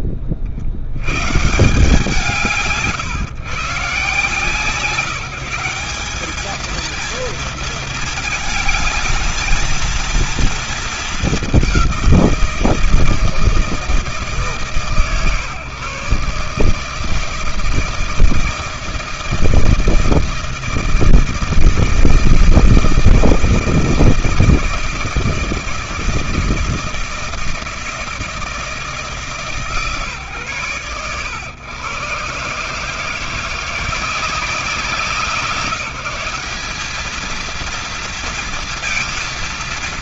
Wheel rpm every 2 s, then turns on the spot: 60, 120, 150, 210, 220, 220, 170, 140, 150, 160, 160, 160, 160, 160, 160, 120, 150, 170, 200, 230.
none